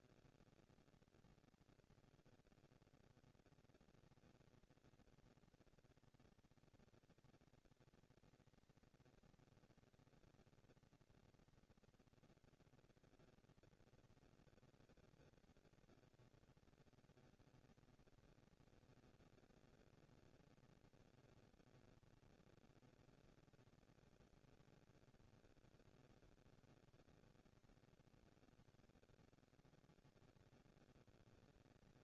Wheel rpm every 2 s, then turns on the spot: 230, 230, 230, 230, 230, 240, 240, 230, 230, 230, 230, 220, 220, 200, 100, 190.
none